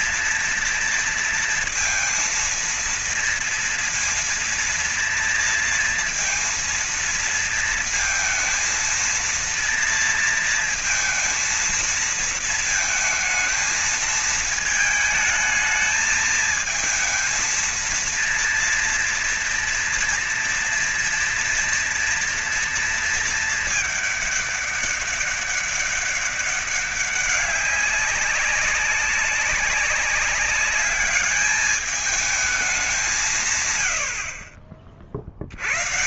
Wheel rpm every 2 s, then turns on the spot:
230, 230, 230, 230, 230, 230, 230, 220, 220, 230, 230, 240, 210, 200, 190, 200, 210, 60.
none